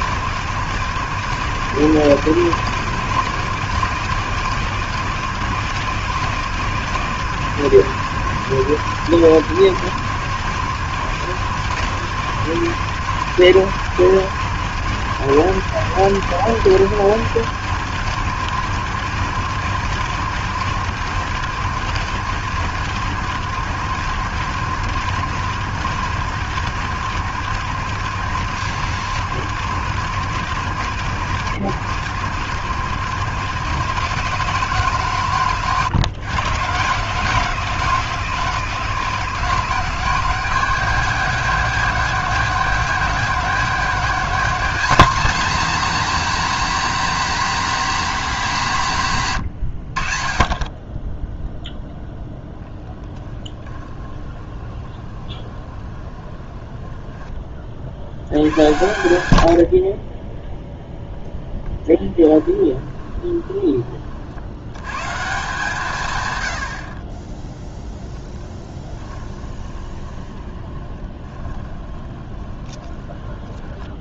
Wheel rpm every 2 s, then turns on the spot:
120, 130, 120, 120, 110, 110, 110, 110, 100, 100, 100, 100, 100, 90, 90, 90, 100, 140, 130, 140, 180, 180, 210, 250, 190, 20, 10, 20, 10, 110, 10, 20, 110, 60, 10, 20, 20.
50-52 54-56 62-64 68-74